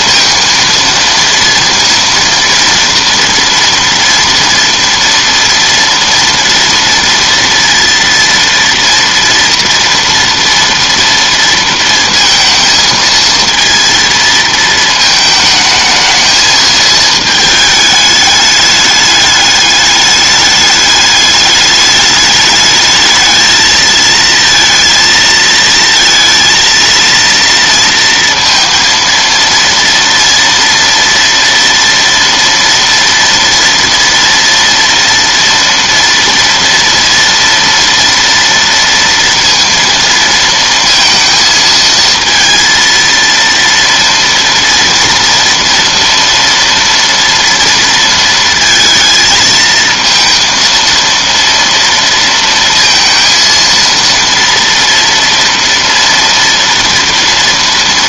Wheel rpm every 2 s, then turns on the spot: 230, 230, 230, 230, 230, 230, 230, 220, 220, 210, 210, 210, 230, 230, 230, 230, 230, 230, 230, 230, 220, 230, 230, 240, 230, 230, 230, 230, 230.
none